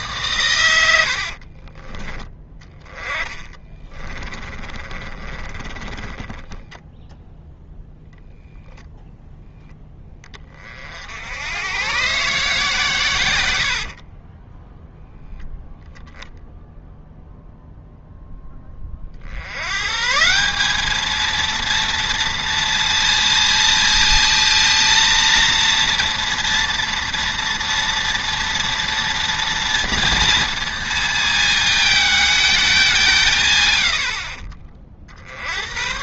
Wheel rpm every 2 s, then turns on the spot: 100, 20, 30, 10, 0, 40, 150, 10, 10, 20, 200, 230, 230, 230, 230, 230, 210, 30.
2-8 14-16